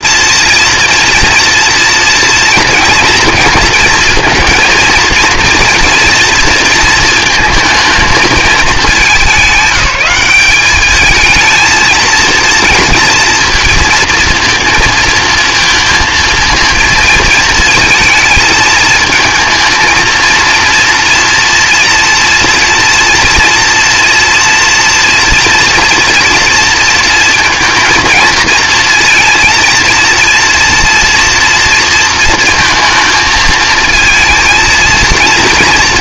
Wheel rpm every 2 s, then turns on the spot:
240, 230, 220, 230, 220, 210, 230, 230, 220, 220, 230, 230, 240, 230, 230, 230, 230, 230.
none